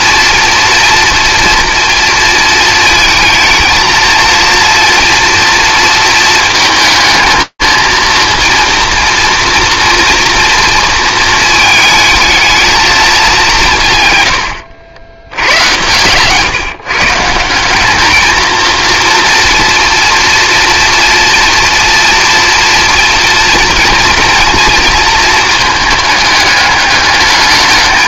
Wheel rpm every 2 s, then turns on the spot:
240, 220, 230, 220, 230, 230, 220, 100, 150, 230, 240, 230, 230, 210.
none